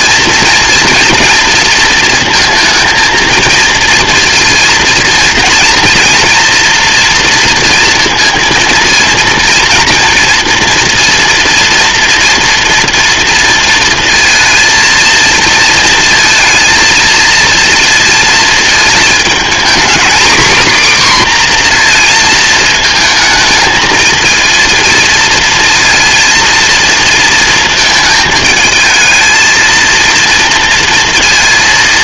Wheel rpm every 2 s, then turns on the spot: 230, 230, 230, 230, 230, 240, 230, 230, 230, 220, 260, 220, 230, 230, 220, 230.
none